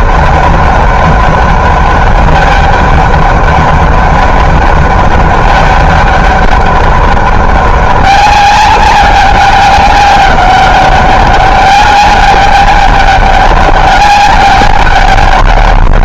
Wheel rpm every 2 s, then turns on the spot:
200, 200, 200, 200, 200, 200, 210, 200.
none